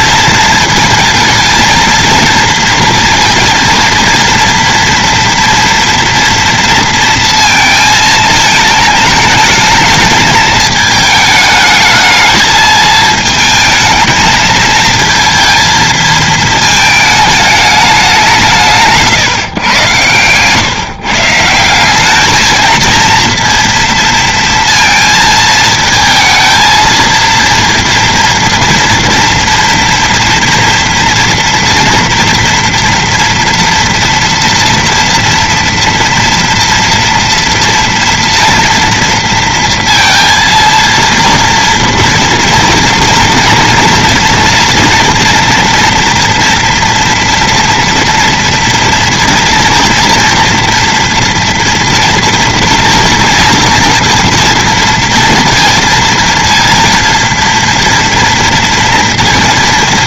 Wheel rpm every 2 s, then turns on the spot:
230, 230, 230, 230, 220, 220, 220, 220, 220, 160, 130, 220, 230, 220, 230, 230, 240, 230, 230, 230, 230, 230, 230, 230, 230, 230, 230, 230, 230, 230.
none